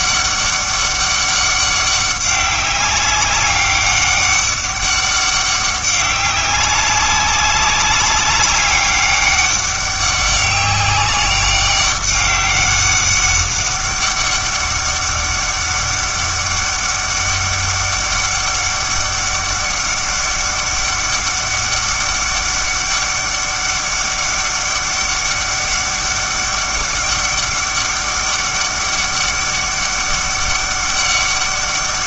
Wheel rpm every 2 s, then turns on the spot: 200, 200, 200, 190, 200, 200, 200, 200, 200, 200, 200, 200, 200, 200, 200, 200.
none